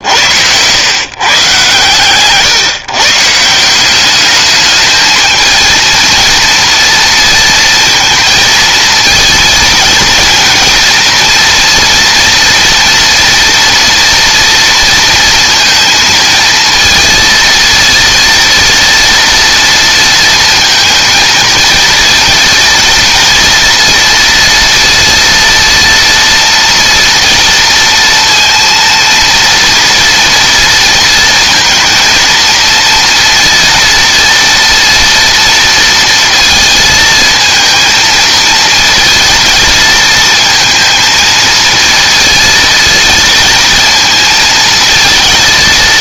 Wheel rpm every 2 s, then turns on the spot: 110, 160, 210, 230, 230, 220, 230, 230, 230, 230, 230, 230, 230, 230, 230, 230, 230, 230, 230, 230, 230, 230, 230.
none